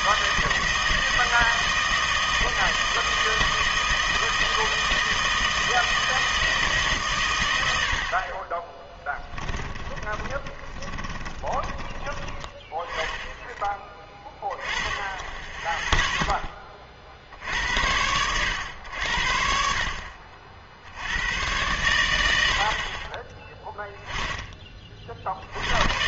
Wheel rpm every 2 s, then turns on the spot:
160, 160, 160, 160, 20, 20, 20, 10, 20, 100, 60, 70, 20.
8-12